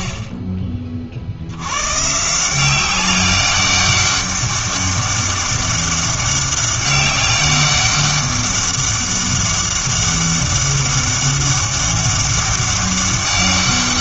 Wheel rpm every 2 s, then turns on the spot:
30, 190, 200, 200, 200, 200, 200.
none